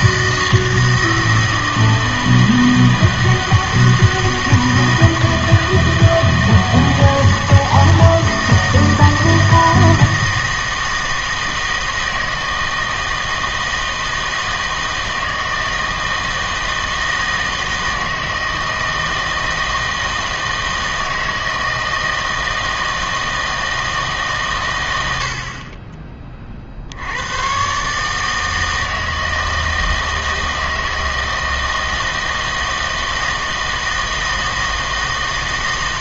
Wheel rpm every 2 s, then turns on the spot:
160, 160, 160, 160, 160, 160, 160, 160, 160, 160, 160, 160, 110, 50, 160, 160, 160, 160.
none